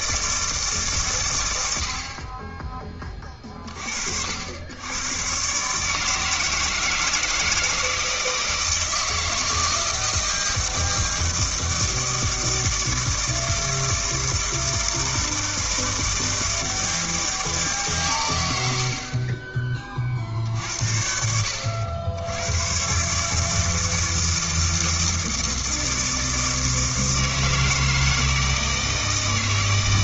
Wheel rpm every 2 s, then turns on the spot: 140, 20, 90, 160, 160, 160, 160, 160, 160, 70, 70, 120, 160, 160, 160.
none